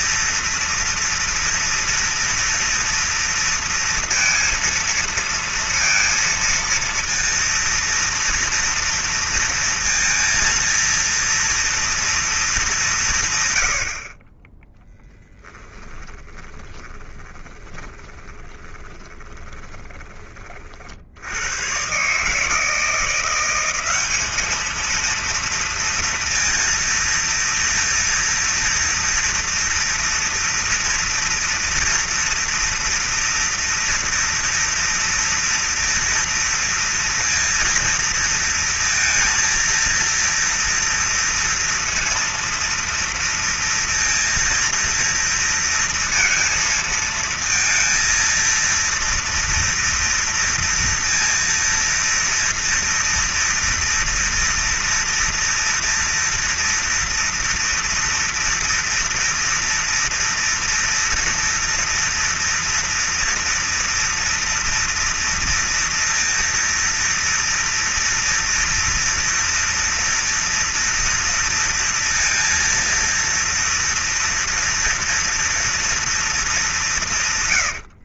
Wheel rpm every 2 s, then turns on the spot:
230, 230, 230, 230, 230, 230, 210, 10, 20, 20, 60, 170, 230, 230, 230, 230, 230, 230, 230, 230, 230, 230, 230, 230, 230, 230, 230, 230, 230, 230, 230, 230, 230, 230, 230, 230, 230, 230, 170.
16-20